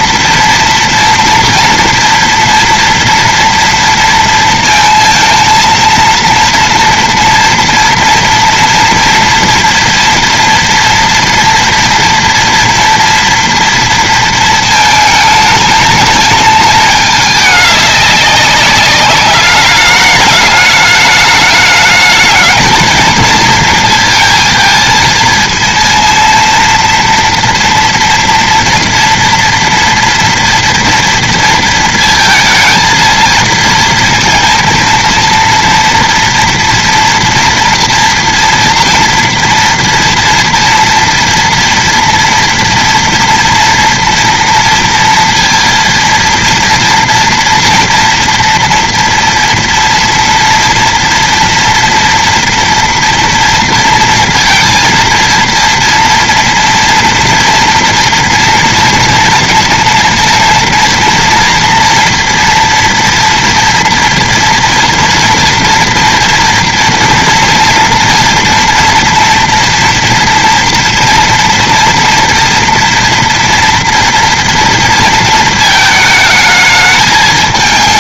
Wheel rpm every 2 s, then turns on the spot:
230, 230, 230, 240, 230, 230, 230, 220, 210, 200, 210, 220, 220, 230, 230, 230, 230, 230, 240, 240, 230, 230, 230, 230, 230, 230, 230, 230, 230, 230, 230, 230, 240, 230, 230, 230, 230, 230, 210.
none